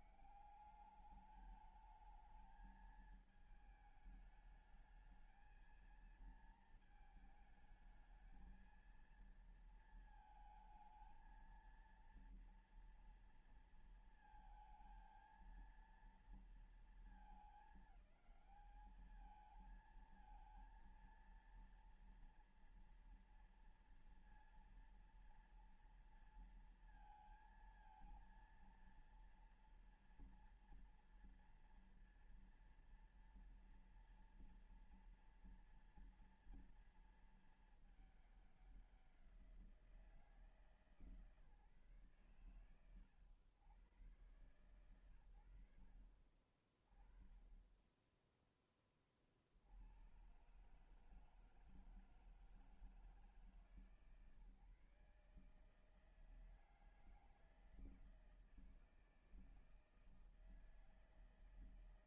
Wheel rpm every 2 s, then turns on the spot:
200, 220, 220, 220, 230, 230, 230, 220, 220, 210, 230, 230, 230, 230, 230, 230, 240, 240, 230, 190, 160, 100, 80, 30, 30, 150, 150, 140, 160, 160, 160.
none